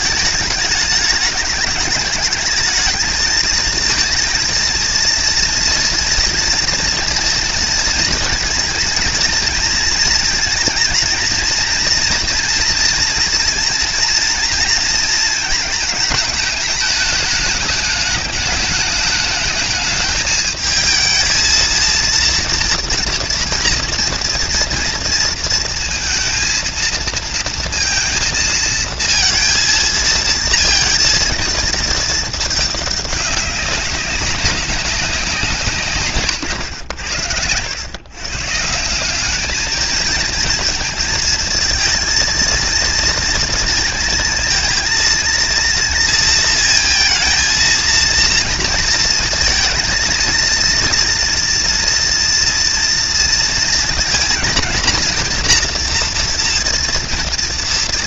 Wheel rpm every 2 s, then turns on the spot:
210, 220, 230, 230, 220, 230, 230, 230, 220, 210, 220, 230, 230, 220, 230, 230, 210, 190, 100, 150, 220, 230, 230, 230, 230, 230, 240, 230, 230.
none